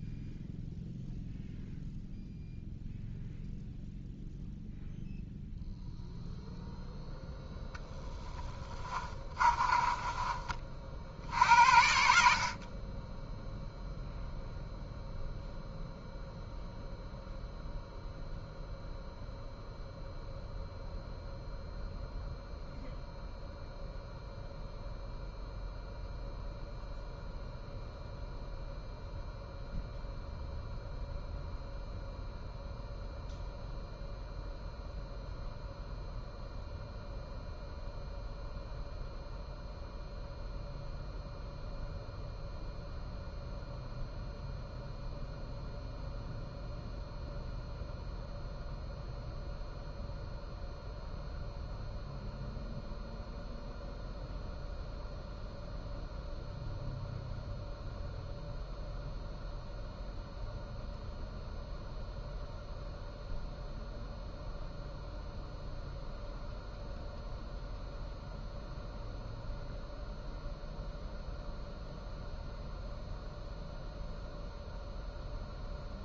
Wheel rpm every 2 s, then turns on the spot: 0, 0, 0, 0, 20, 50, 30, 0, 0, 0, 0, 0, 0, 0, 0, 0, 0, 0, 0, 0, 0, 0, 0, 0, 0, 0, 0, 0, 0, 0, 0, 0, 0, 0, 0, 0, 0, 0.
8-10